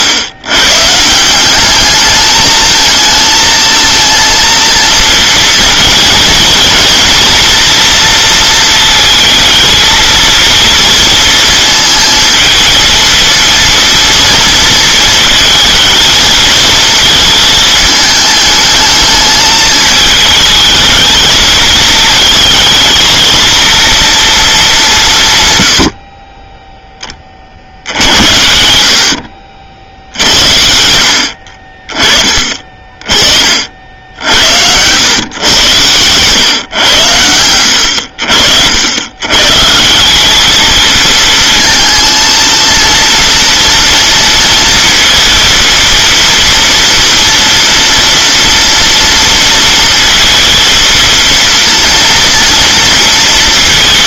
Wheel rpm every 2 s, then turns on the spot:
150, 220, 230, 230, 230, 230, 230, 230, 230, 220, 220, 230, 210, 10, 60, 80, 40, 100, 110, 80, 220, 230, 230, 230, 230, 230, 230.
none